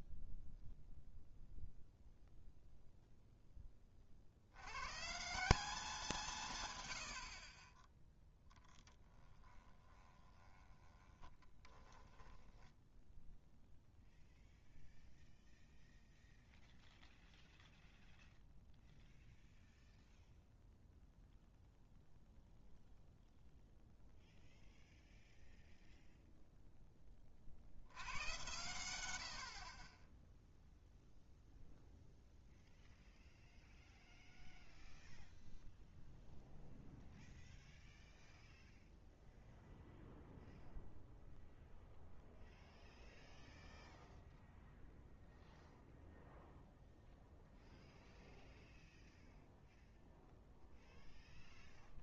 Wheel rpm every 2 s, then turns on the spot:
0, 0, 130, 70, 10, 20, 0, 0, 0, 0, 0, 0, 0, 10, 100, 0, 0, 0, 0, 0, 0, 0, 0, 0, 0, 0.
8-12